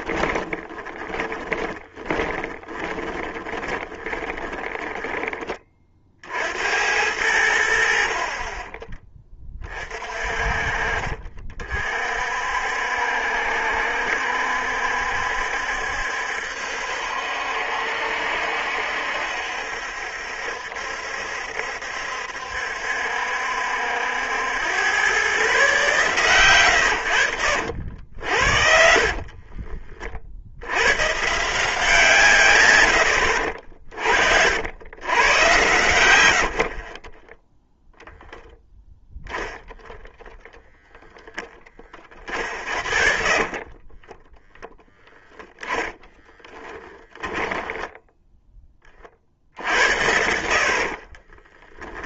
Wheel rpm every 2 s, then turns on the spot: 20, 30, 20, 80, 30, 40, 60, 70, 70, 70, 70, 70, 120, 120, 50, 110, 100, 100, 20, 10, 0, 40, 10, 10, 30, 40.
0-4 28-30 36-38 42-44 46-48 50-52